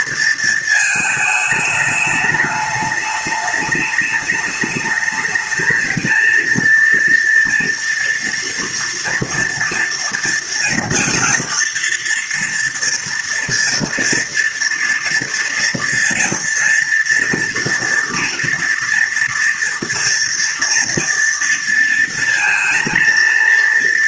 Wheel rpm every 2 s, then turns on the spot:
230, 210, 210, 230, 230, 230, 240, 230, 230, 230, 230, 230.
none